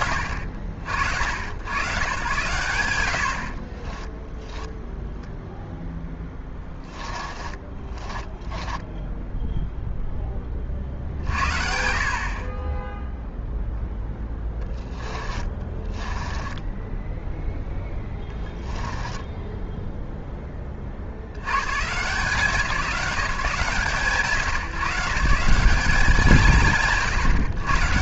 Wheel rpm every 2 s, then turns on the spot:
70, 70, 0, 20, 10, 60, 0, 20, 10, 20, 70, 180, 150, 110.
6-10 14-20